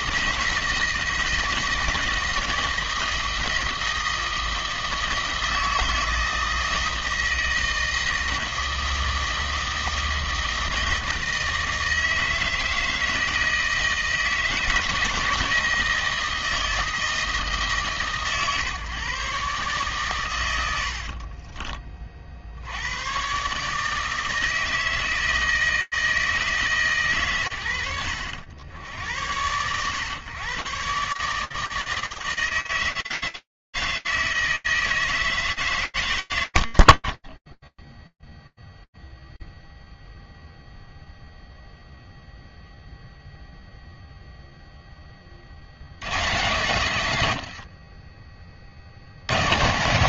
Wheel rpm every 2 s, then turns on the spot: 160, 160, 160, 160, 160, 160, 160, 160, 160, 130, 80, 80, 160, 130, 80, 130, 160, 160, 10, 0, 0, 0, 50, 90, 90.
20-22